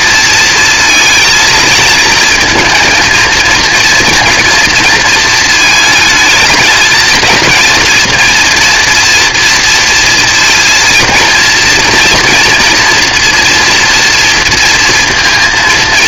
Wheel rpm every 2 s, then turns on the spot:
230, 220, 230, 220, 230, 230, 230, 230.
none